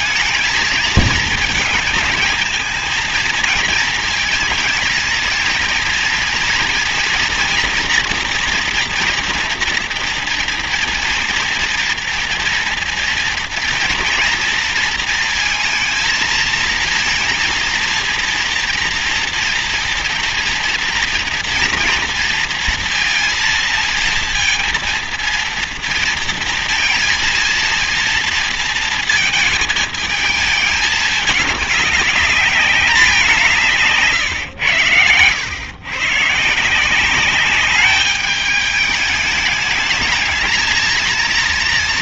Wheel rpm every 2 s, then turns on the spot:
230, 220, 220, 230, 240, 240, 230, 230, 230, 230, 230, 230, 230, 230, 230, 210, 200, 110, 170, 210, 220.
none